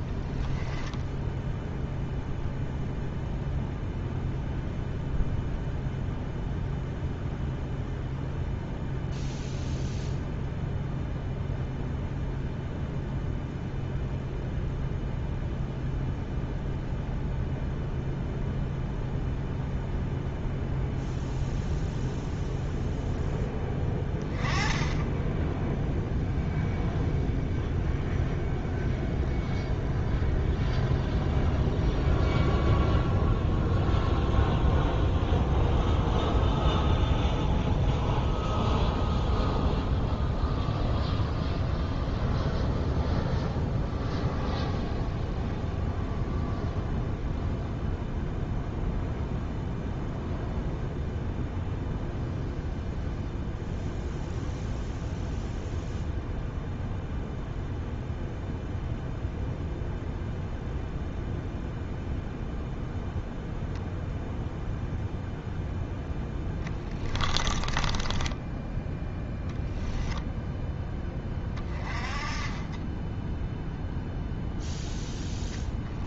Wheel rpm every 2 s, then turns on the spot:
10, 0, 0, 0, 0, 0, 0, 0, 0, 0, 0, 0, 20, 0, 0, 0, 0, 0, 0, 0, 0, 0, 0, 0, 0, 0, 0, 0, 0, 0, 0, 0, 0, 10, 10, 10, 20, 0.
66-68